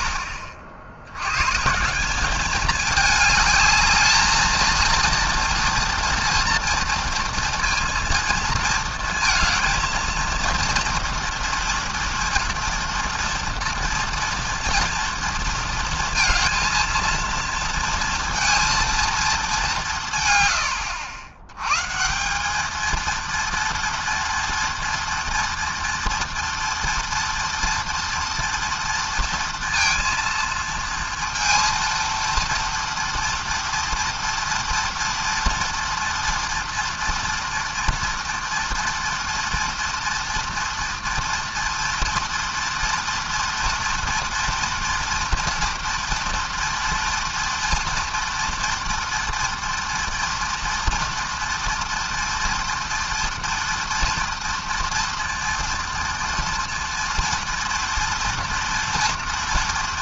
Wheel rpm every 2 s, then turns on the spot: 70, 210, 230, 230, 230, 230, 230, 230, 230, 230, 100, 210, 230, 240, 230, 230, 230, 230, 230, 230, 230, 240, 230, 230, 230, 230, 240, 230, 230, 240.
none